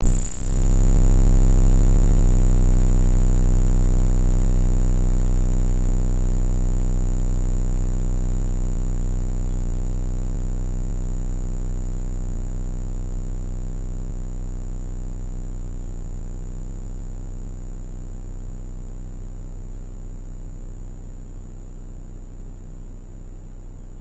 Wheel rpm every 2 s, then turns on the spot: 0, 0, 0, 0, 0, 0, 0, 0, 0, 0, 0, 0.
none